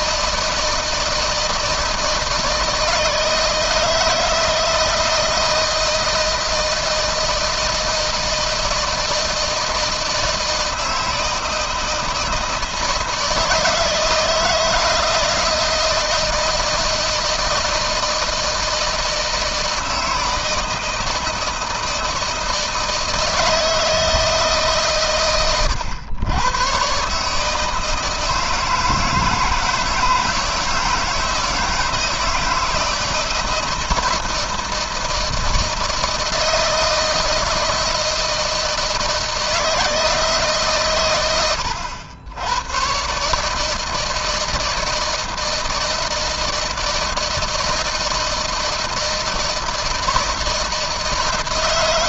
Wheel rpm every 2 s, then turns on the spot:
160, 160, 160, 160, 160, 160, 160, 160, 160, 160, 160, 160, 130, 130, 160, 160, 160, 160, 160, 160, 120, 130, 160, 160, 160, 160.
none